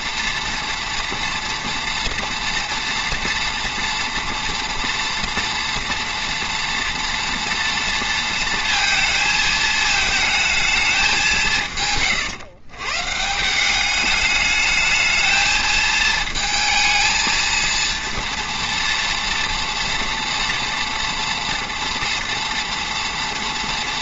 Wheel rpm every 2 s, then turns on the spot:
230, 230, 230, 240, 230, 220, 130, 210, 220, 230, 230, 230.
none